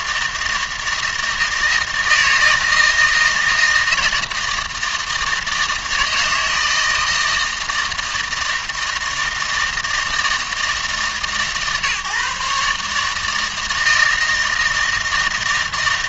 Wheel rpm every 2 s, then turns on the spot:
160, 160, 160, 160, 160, 160, 150, 160.
none